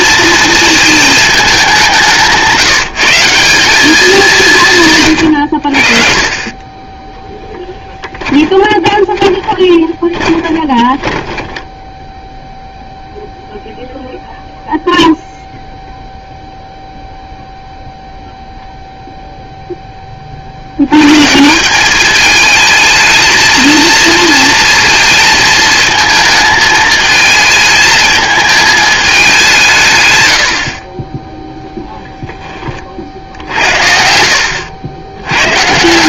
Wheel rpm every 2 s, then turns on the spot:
230, 170, 150, 20, 20, 20, 0, 0, 0, 0, 70, 220, 230, 220, 220, 80, 20, 80.
8-12